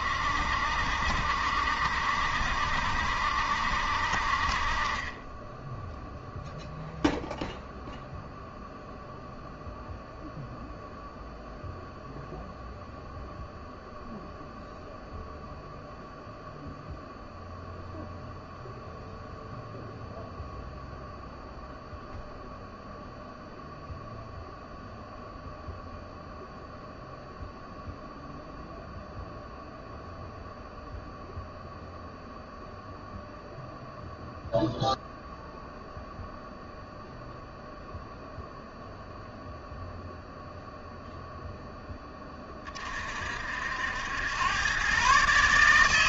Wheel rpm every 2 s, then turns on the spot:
60, 70, 30, 0, 0, 0, 0, 0, 0, 0, 0, 0, 0, 0, 0, 0, 0, 0, 0, 0, 0, 30, 130.
none